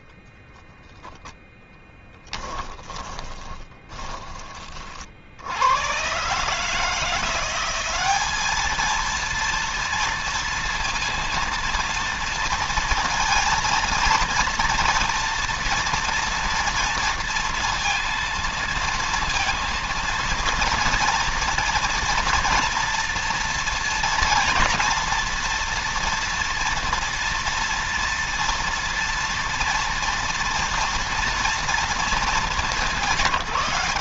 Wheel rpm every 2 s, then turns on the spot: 10, 30, 60, 160, 220, 230, 230, 230, 230, 230, 230, 240, 240, 230, 230, 230, 200.
2-4